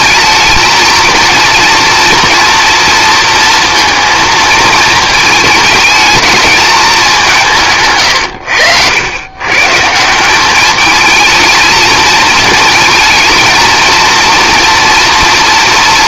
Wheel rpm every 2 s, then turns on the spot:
220, 230, 220, 210, 90, 220, 220, 230.
none